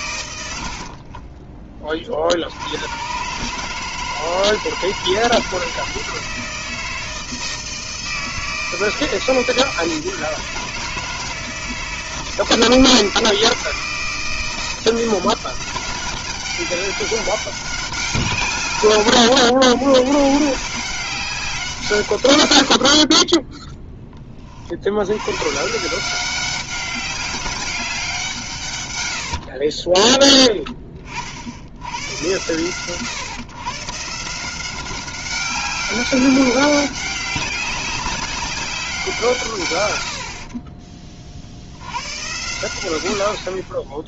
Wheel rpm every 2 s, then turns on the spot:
70, 90, 160, 160, 160, 160, 160, 160, 190, 140, 170, 70, 50, 190, 140, 20, 120, 180, 190, 190, 40, 100.
0-2